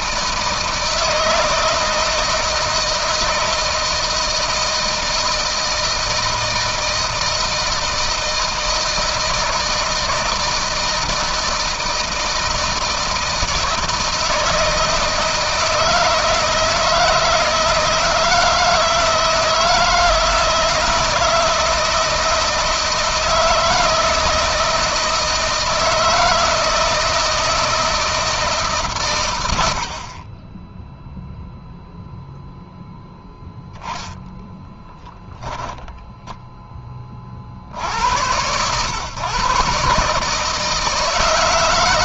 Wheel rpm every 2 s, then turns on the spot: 160, 160, 160, 160, 160, 160, 160, 160, 160, 160, 160, 160, 160, 160, 130, 0, 10, 10, 10, 110, 160.
34-36